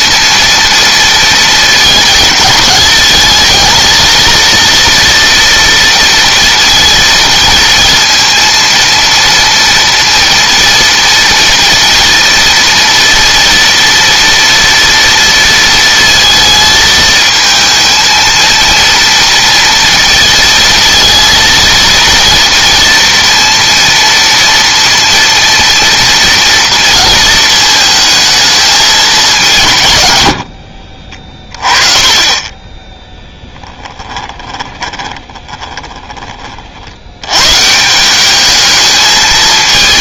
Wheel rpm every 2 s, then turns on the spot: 230, 220, 230, 230, 230, 230, 230, 230, 220, 230, 220, 230, 230, 230, 210, 50, 10, 20, 70, 220.
30-32 34-36